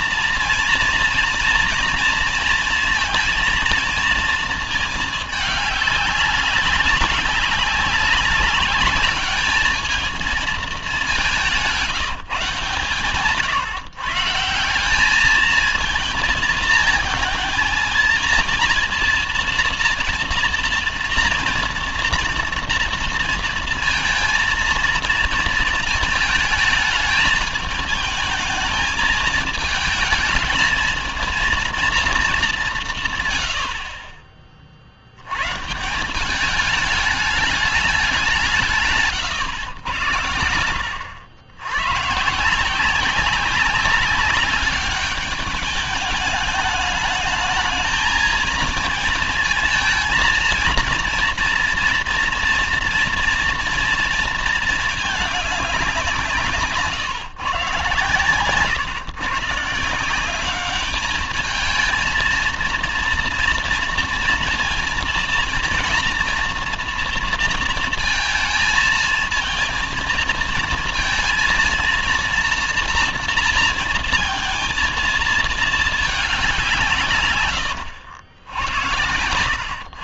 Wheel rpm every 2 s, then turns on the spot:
230, 230, 220, 200, 200, 210, 150, 170, 220, 230, 230, 230, 230, 220, 220, 220, 190, 40, 200, 170, 90, 160, 200, 210, 230, 230, 240, 230, 170, 130, 200, 230, 230, 230, 220, 230, 230, 230, 190, 80.
none